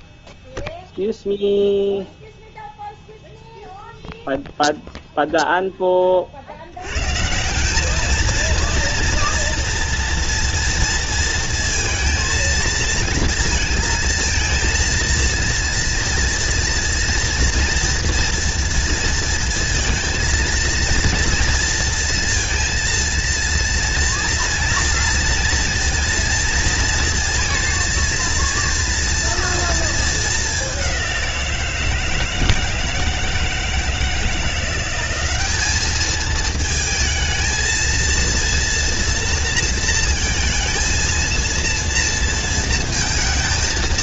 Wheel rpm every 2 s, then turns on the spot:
0, 0, 0, 80, 230, 230, 220, 230, 230, 230, 230, 230, 230, 230, 230, 200, 160, 180, 220, 230, 230, 230.
none